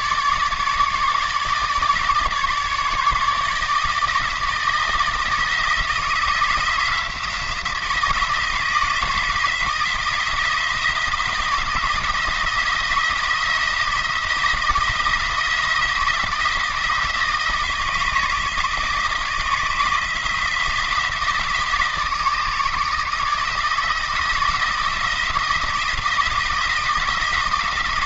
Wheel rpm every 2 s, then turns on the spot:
150, 150, 160, 170, 160, 170, 170, 170, 160, 160, 170, 160, 160, 170.
none